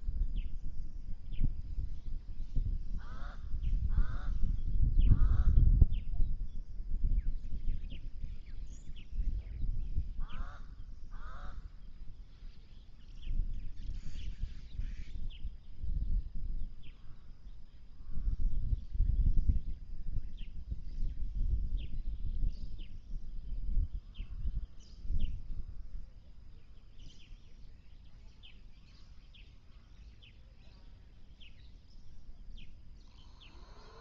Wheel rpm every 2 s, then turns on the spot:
0, 0, 0, 0, 0, 0, 0, 0, 0, 0, 0, 0, 0, 0, 0, 0, 0.
none